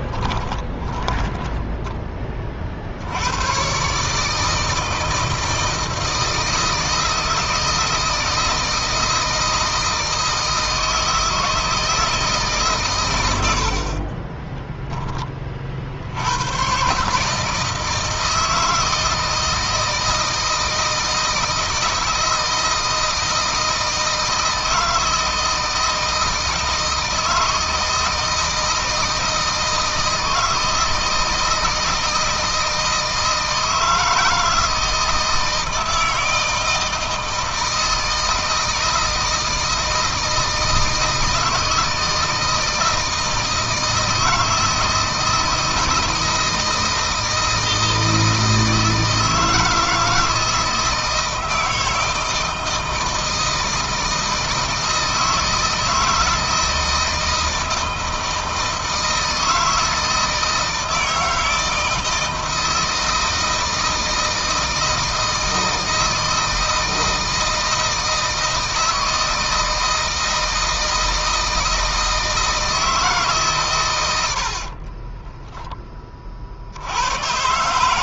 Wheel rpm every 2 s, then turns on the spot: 20, 50, 160, 160, 160, 160, 140, 10, 100, 160, 160, 160, 160, 160, 170, 160, 160, 160, 160, 160, 160, 160, 160, 160, 160, 160, 160, 160, 160, 160, 160, 160, 160, 160, 160, 160, 160, 50, 60.
0-2 74-76